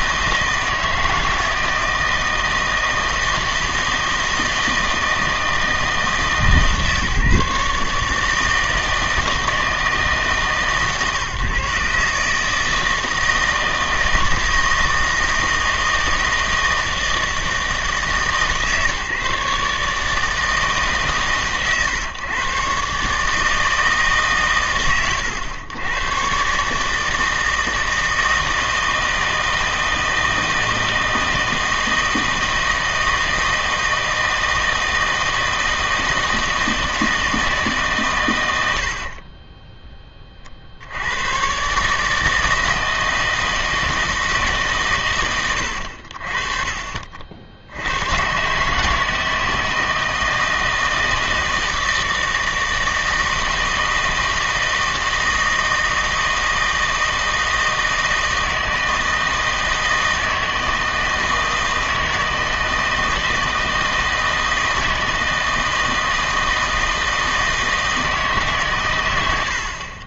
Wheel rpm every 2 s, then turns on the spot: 160, 160, 160, 150, 160, 140, 160, 160, 160, 150, 150, 140, 120, 150, 160, 160, 160, 160, 160, 70, 70, 160, 130, 40, 150, 160, 160, 160, 160, 160, 160, 160, 160, 160, 120.
none